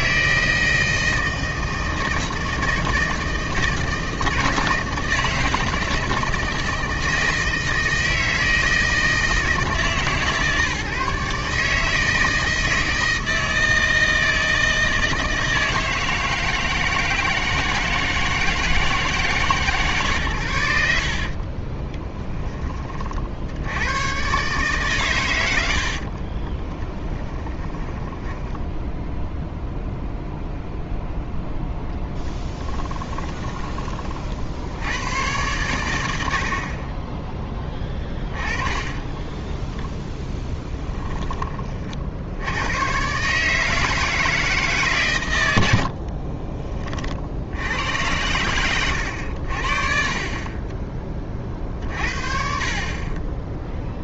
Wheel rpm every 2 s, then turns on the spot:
160, 160, 160, 160, 160, 150, 160, 160, 160, 160, 80, 40, 130, 10, 0, 0, 10, 100, 30, 10, 10, 110, 150, 30, 100, 20, 40.
20-22 26-28 32-34